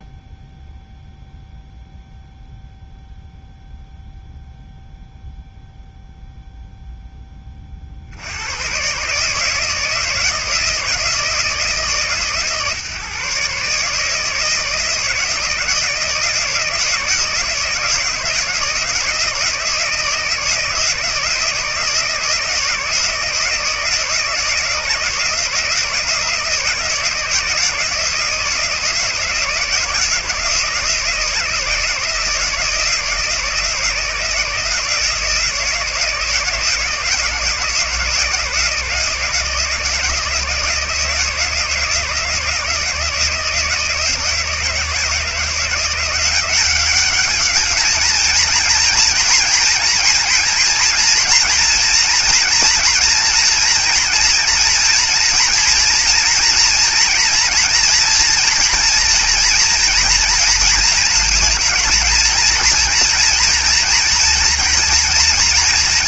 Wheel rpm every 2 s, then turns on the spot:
0, 0, 0, 10, 130, 160, 140, 160, 160, 160, 160, 160, 160, 160, 160, 170, 160, 160, 160, 160, 160, 160, 160, 200, 230, 230, 240, 240, 230, 230, 230, 230, 240.
none